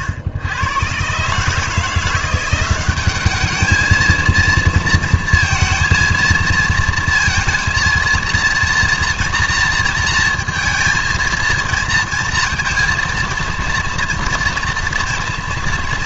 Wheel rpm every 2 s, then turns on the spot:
110, 180, 230, 230, 240, 230, 230, 230.
none